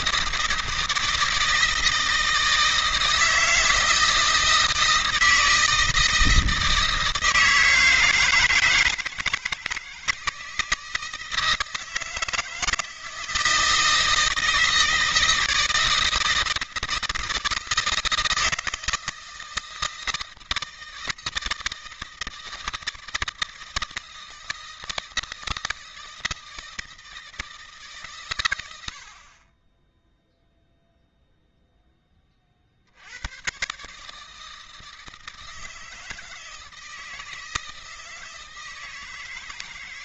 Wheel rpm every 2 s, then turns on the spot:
160, 160, 160, 160, 160, 160, 160, 160, 160, 160, 160, 160, 160, 160, 90, 0, 60, 160, 160, 160.
none